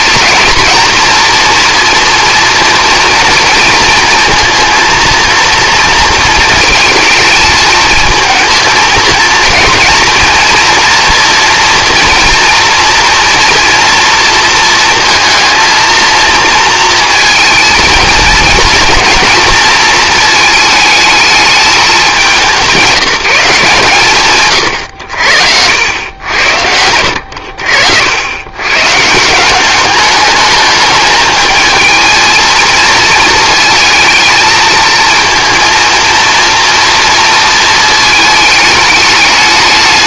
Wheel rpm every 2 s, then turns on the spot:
230, 230, 230, 230, 220, 240, 240, 230, 230, 230, 220, 190, 110, 80, 130, 210, 230, 220, 230, 220.
none